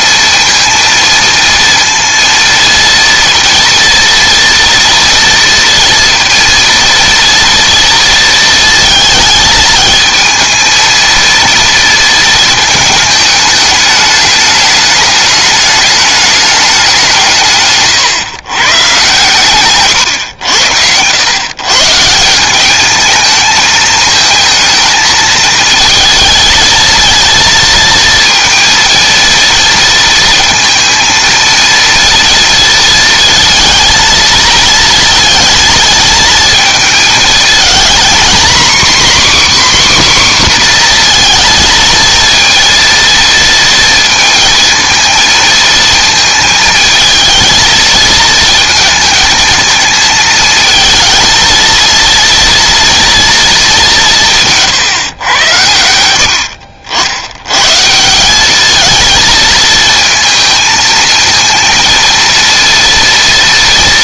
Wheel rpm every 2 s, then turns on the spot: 230, 230, 230, 230, 220, 230, 220, 210, 190, 130, 100, 210, 220, 230, 230, 230, 230, 230, 220, 270, 250, 230, 230, 220, 230, 220, 230, 140, 70, 220, 220, 230.
none